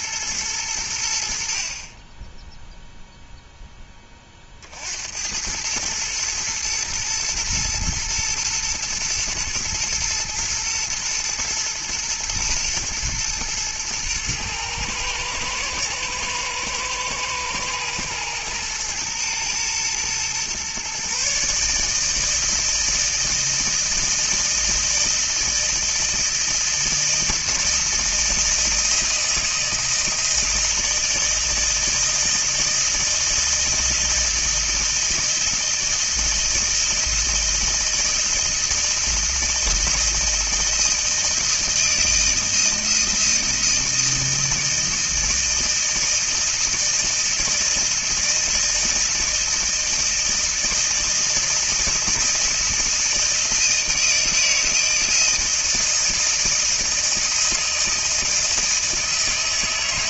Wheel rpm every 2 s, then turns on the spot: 90, 0, 70, 110, 120, 110, 110, 110, 110, 110, 130, 160, 160, 160, 160, 160, 160, 160, 160, 160, 160, 160, 160, 160, 160, 160, 160, 160, 160, 160.
none